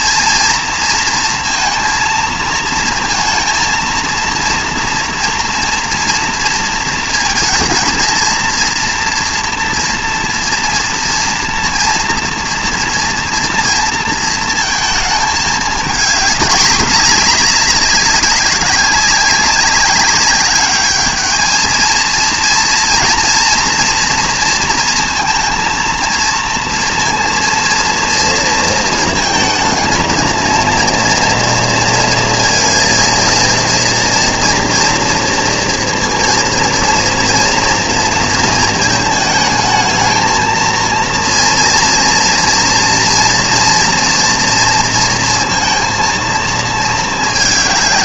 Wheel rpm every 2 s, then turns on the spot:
230, 230, 230, 230, 230, 230, 230, 230, 210, 200, 200, 230, 230, 230, 230, 230, 230, 240, 230, 230, 220, 230, 230, 230.
none